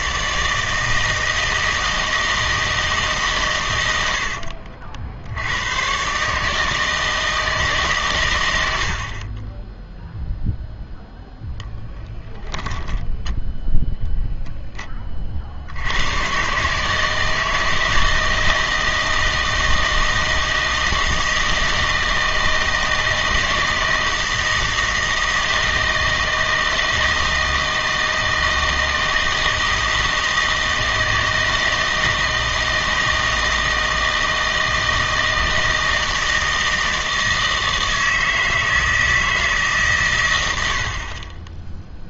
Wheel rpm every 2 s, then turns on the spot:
160, 160, 60, 150, 100, 0, 10, 10, 140, 160, 160, 160, 160, 160, 160, 160, 160, 160, 160, 160, 80.
4-6